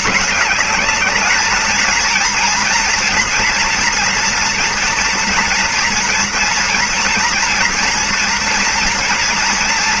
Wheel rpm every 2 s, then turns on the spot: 220, 230, 230, 230, 240.
none